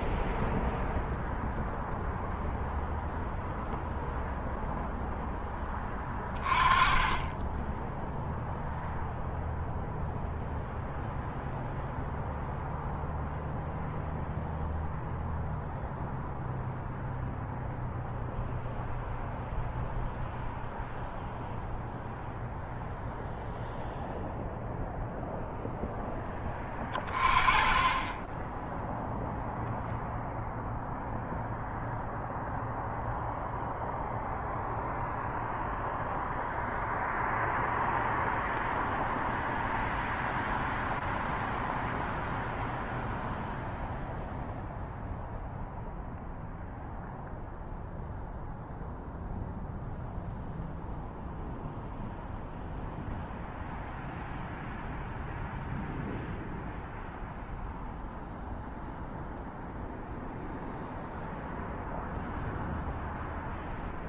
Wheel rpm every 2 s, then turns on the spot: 0, 0, 0, 20, 0, 0, 0, 0, 0, 0, 0, 0, 0, 10, 20, 0, 0, 0, 0, 0, 0, 0, 0, 0, 0, 0, 0, 0, 0, 0, 0, 0.
none